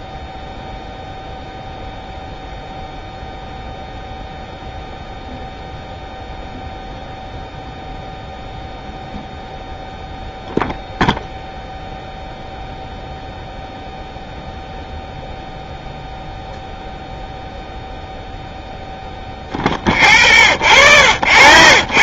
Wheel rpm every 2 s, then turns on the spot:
0, 0, 0, 0, 0, 0, 0, 0, 0, 0, 0.
none